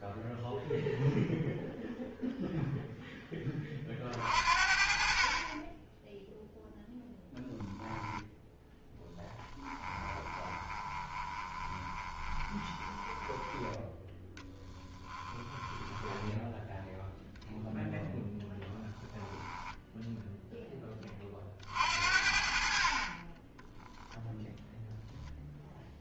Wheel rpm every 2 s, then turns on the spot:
0, 0, 50, 0, 10, 20, 20, 20, 0, 10, 10, 50, 0.
8-16 18-20